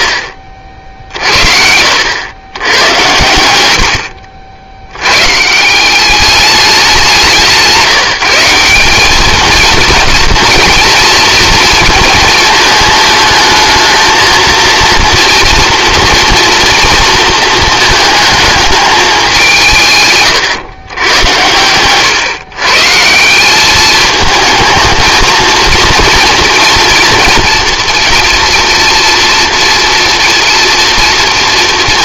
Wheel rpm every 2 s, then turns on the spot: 50, 100, 70, 200, 180, 230, 220, 230, 240, 220, 120, 130, 220, 230, 240, 240.
0-2